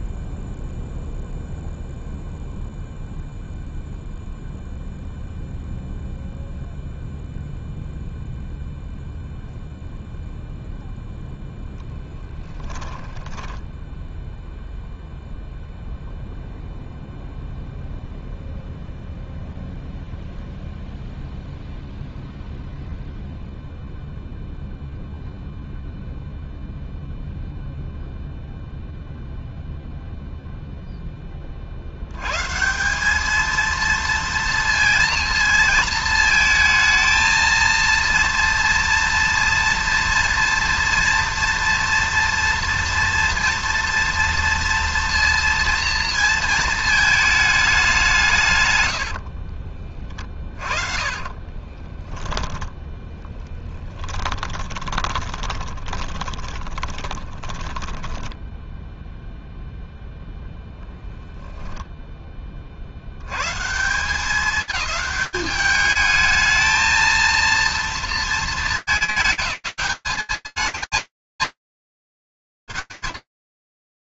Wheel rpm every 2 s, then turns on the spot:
0, 0, 0, 0, 0, 0, 10, 0, 0, 0, 0, 0, 0, 0, 0, 170, 230, 220, 230, 230, 230, 230, 220, 100, 30, 10, 40, 20, 10, 0, 0, 190, 210, 230, 200, 220, 160.
12-14 48-50 52-58